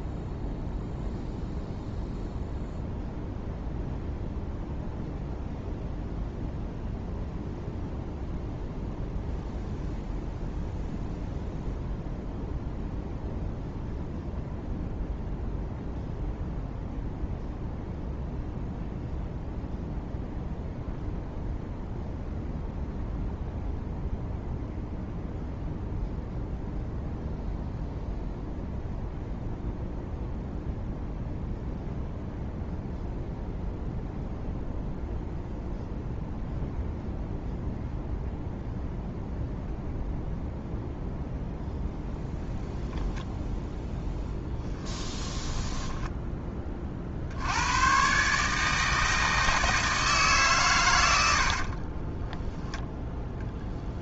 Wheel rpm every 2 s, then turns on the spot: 0, 0, 0, 0, 0, 0, 0, 0, 0, 0, 0, 0, 0, 0, 0, 0, 0, 0, 0, 0, 0, 0, 10, 30, 160, 120, 0.
44-46